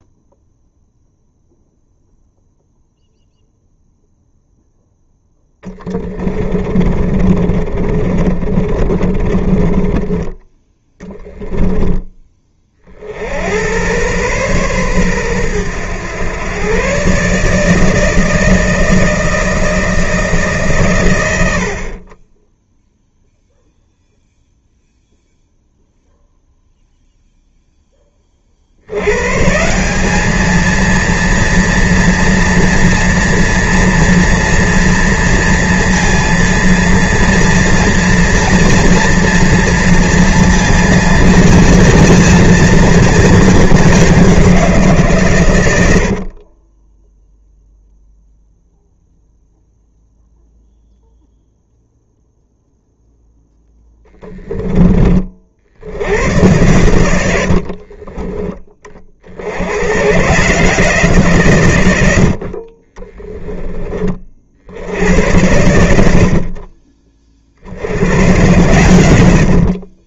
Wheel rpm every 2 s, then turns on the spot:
0, 0, 0, 30, 40, 10, 50, 120, 130, 160, 120, 0, 0, 0, 80, 230, 240, 240, 230, 230, 230, 230, 150, 10, 0, 0, 0, 20, 110, 30, 160, 40, 90, 40, 110.
6-10 46-48 56-58 62-64